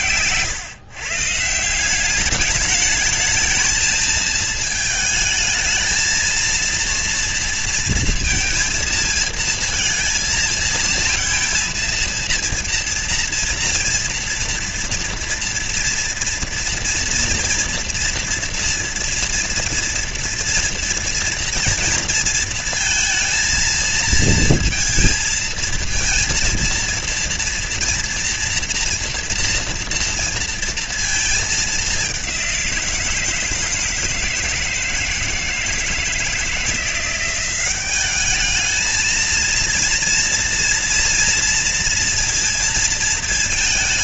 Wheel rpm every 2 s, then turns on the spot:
120, 210, 220, 230, 230, 220, 230, 230, 230, 230, 230, 220, 230, 230, 240, 230, 190, 160, 170, 210, 240, 230.
none